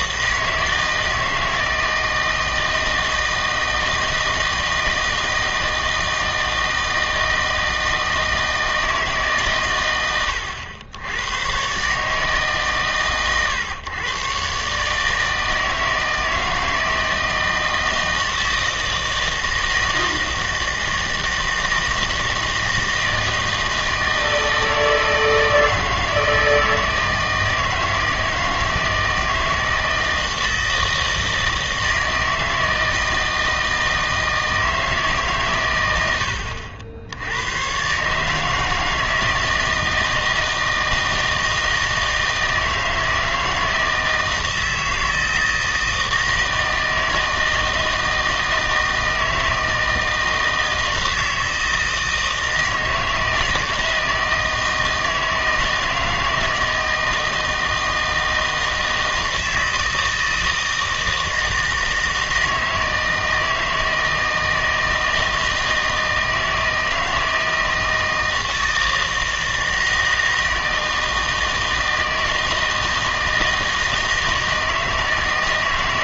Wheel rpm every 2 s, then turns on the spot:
160, 160, 160, 160, 160, 90, 140, 150, 160, 160, 160, 160, 160, 160, 160, 160, 160, 160, 80, 160, 160, 160, 160, 160, 160, 160, 160, 160, 160, 160, 160, 160, 160, 160, 160, 160, 160, 160.
none